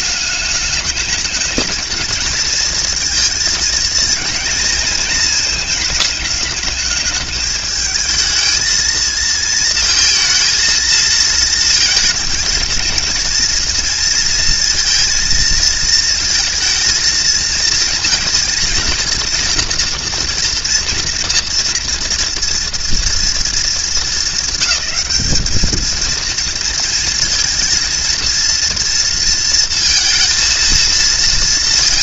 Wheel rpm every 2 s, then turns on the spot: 210, 220, 220, 210, 220, 230, 230, 230, 230, 230, 230, 230, 190, 230, 230, 230.
none